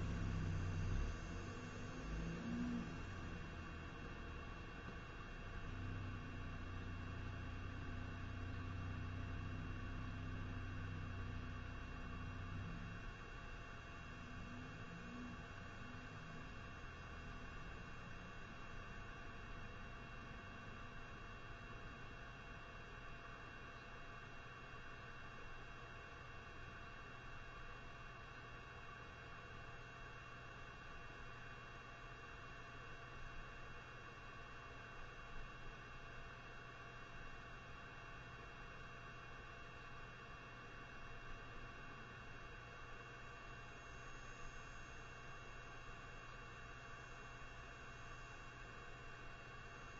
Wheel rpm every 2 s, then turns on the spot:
0, 0, 0, 0, 0, 0, 0, 0, 0, 0, 0, 0, 0, 0, 0, 0, 0, 0, 0, 0, 0, 0, 0, 0, 0.
none